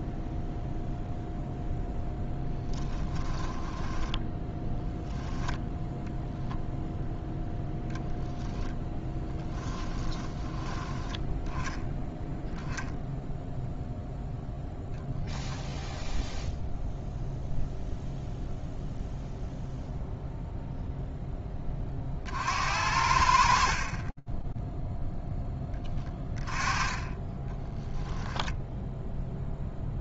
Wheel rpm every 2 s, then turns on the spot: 0, 20, 0, 0, 0, 10, 0, 0, 0, 0, 0, 60, 20, 20, 0.
2-4 24-26